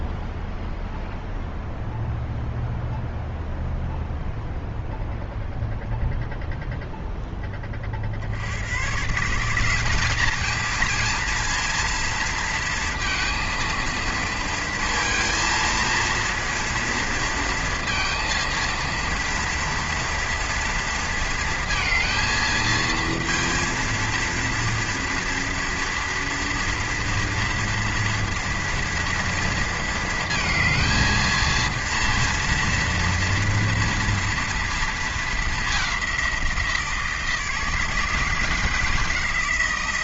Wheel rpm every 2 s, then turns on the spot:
0, 0, 0, 0, 100, 220, 230, 230, 230, 230, 230, 220, 230, 240, 230, 220, 230, 230, 170, 170.
none